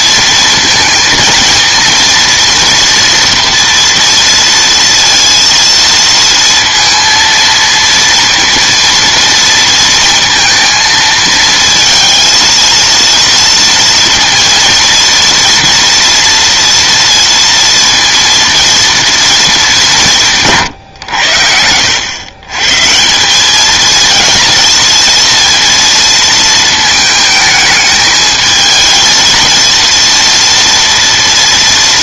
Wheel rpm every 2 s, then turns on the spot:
230, 230, 230, 230, 230, 220, 230, 230, 230, 230, 130, 150, 230, 220, 220, 230.
none